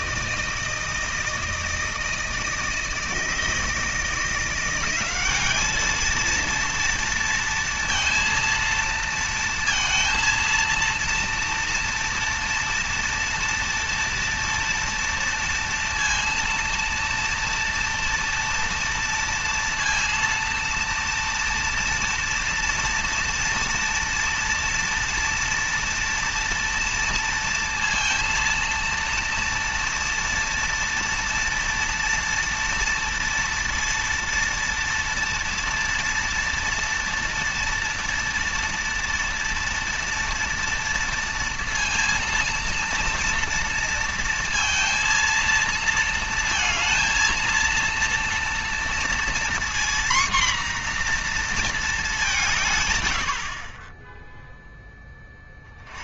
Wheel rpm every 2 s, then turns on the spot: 160, 160, 180, 230, 230, 230, 230, 230, 230, 230, 230, 230, 230, 230, 230, 240, 230, 230, 230, 230, 230, 230, 230, 230, 230, 250, 130, 10.
none